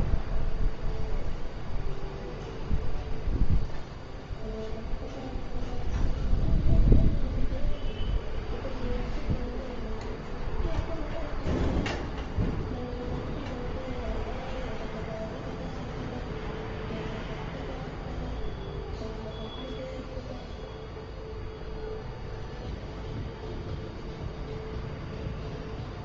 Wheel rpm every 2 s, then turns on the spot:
0, 0, 0, 0, 0, 0, 0, 0, 0, 0, 0, 0, 0.
none